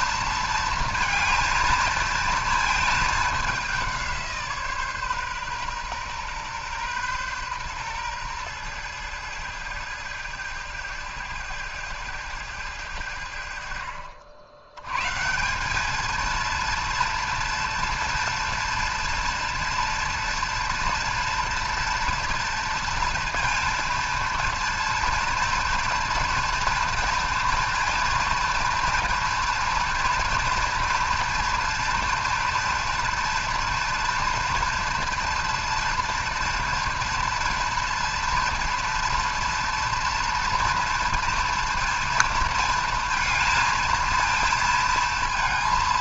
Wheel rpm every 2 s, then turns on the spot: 230, 220, 150, 120, 110, 110, 100, 100, 230, 230, 230, 230, 230, 240, 230, 240, 230, 230, 230, 230, 230, 230, 230.
none